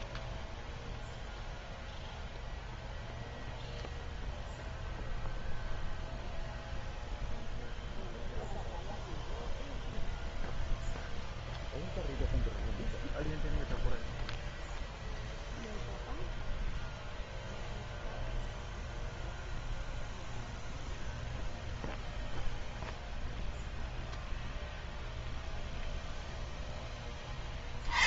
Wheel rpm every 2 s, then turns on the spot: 0, 0, 0, 0, 0, 0, 0, 0, 0, 0, 0, 0, 0, 10.
none